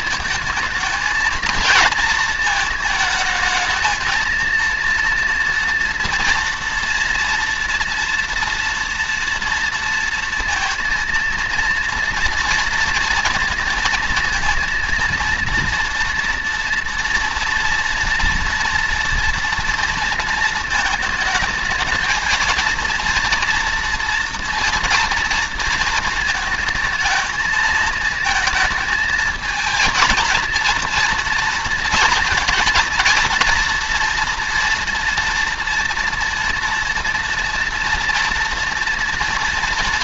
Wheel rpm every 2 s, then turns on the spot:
220, 220, 230, 230, 240, 230, 230, 230, 240, 230, 230, 220, 230, 230, 220, 230, 230, 240, 230, 230.
none